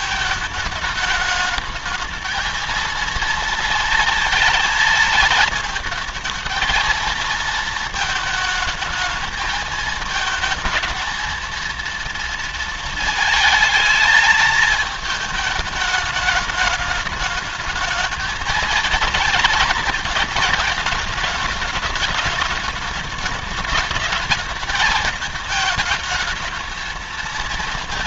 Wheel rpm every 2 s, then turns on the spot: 220, 220, 230, 220, 220, 220, 230, 220, 210, 220, 210, 220, 220, 220.
none